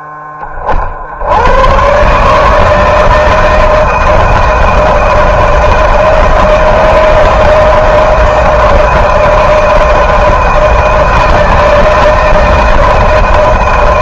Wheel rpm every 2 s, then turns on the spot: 20, 140, 160, 160, 160, 160, 160.
none